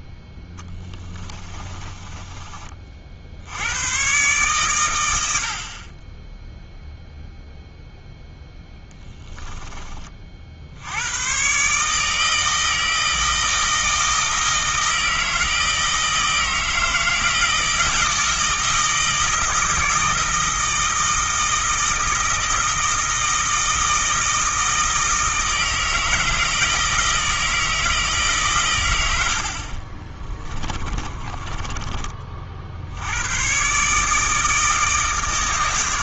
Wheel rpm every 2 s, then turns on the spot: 20, 40, 120, 0, 10, 80, 160, 160, 160, 160, 160, 160, 160, 160, 110, 20, 60, 160.
0-2 30-32